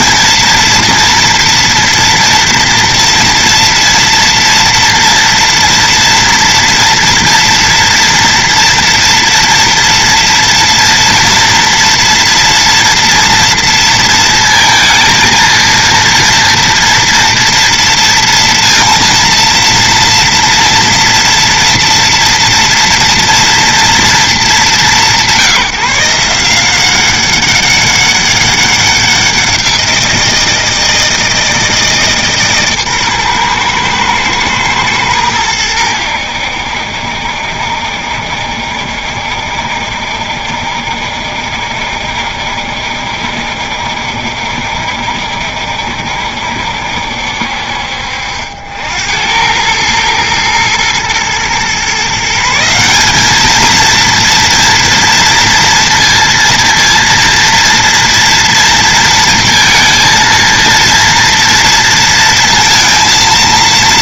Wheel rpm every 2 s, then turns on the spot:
230, 230, 230, 230, 240, 230, 230, 230, 230, 230, 230, 230, 190, 170, 190, 170, 140, 110, 80, 70, 70, 60, 70, 70, 70, 110, 180, 230, 230, 230, 230, 230.
none